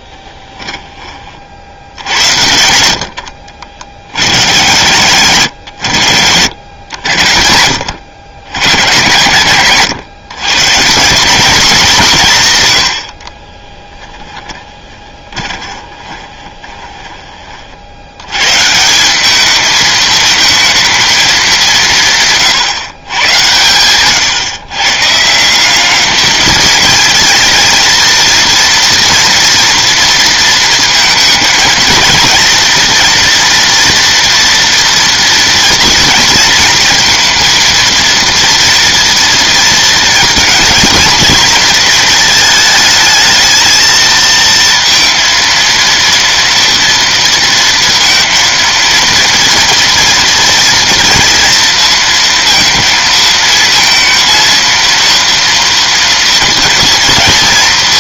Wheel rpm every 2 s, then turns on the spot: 10, 80, 90, 90, 110, 140, 160, 10, 20, 130, 220, 150, 140, 220, 230, 230, 230, 230, 220, 230, 230, 220, 230, 230, 230, 240, 230, 230, 230.
0-2 14-18